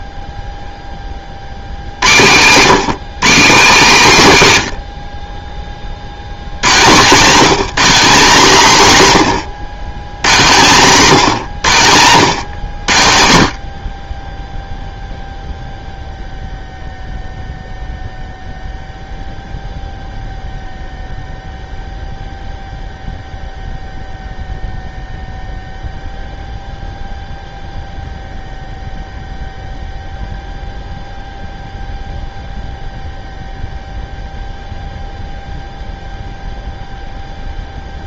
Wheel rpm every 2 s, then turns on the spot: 10, 150, 110, 140, 160, 150, 90, 0, 0, 0, 0, 0, 0, 0, 0, 0, 0, 0, 0.
none